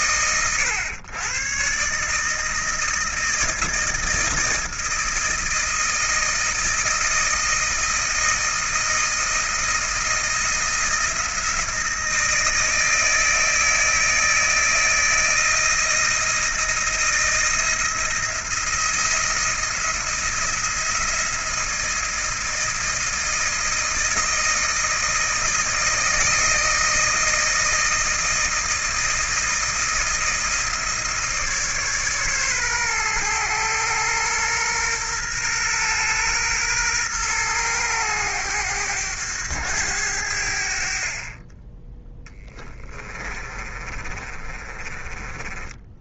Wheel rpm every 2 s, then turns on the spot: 100, 160, 160, 160, 160, 170, 160, 160, 160, 170, 170, 160, 160, 160, 160, 160, 130, 120, 120, 100, 60, 20, 30.
42-46